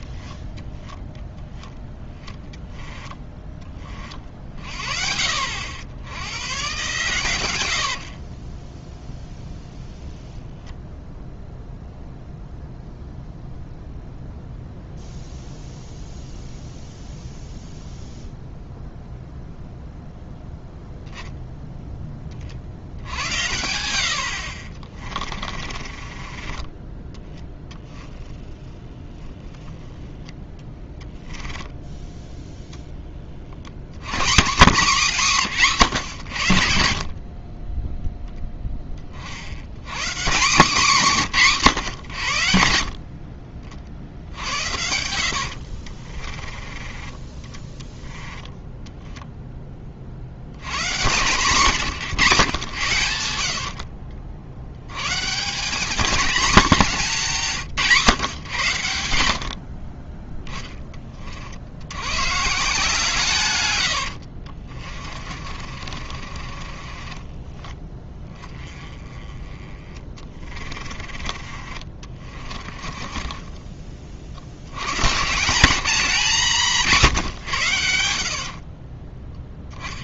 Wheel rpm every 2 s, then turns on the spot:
20, 10, 50, 130, 10, 0, 0, 0, 0, 0, 0, 70, 30, 20, 10, 10, 10, 200, 50, 30, 200, 60, 70, 20, 0, 120, 110, 110, 200, 100, 20, 150, 40, 30, 30, 30, 30, 130, 160, 30.
0-2 8-10 22-32 36-38 46-48 64-68 70-74 78-80